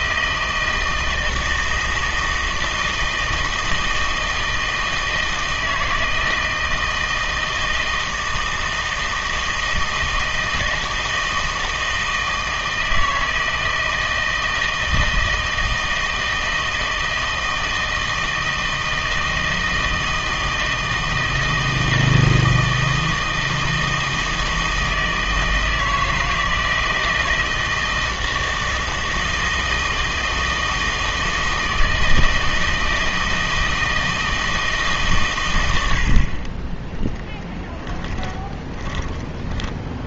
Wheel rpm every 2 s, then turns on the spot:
160, 160, 160, 160, 160, 160, 160, 160, 160, 160, 160, 160, 160, 160, 160, 160, 160, 150, 20, 20.
38-40